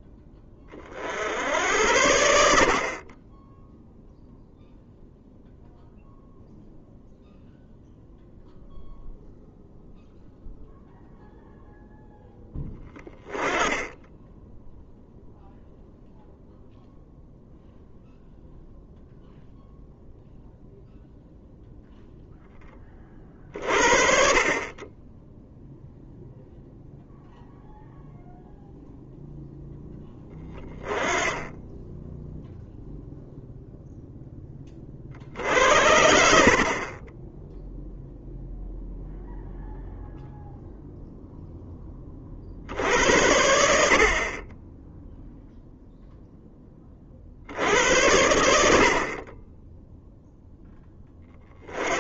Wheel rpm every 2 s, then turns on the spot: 40, 50, 0, 0, 0, 0, 10, 0, 0, 0, 0, 30, 20, 0, 0, 20, 0, 40, 30, 0, 0, 80, 10, 20, 60, 10.
none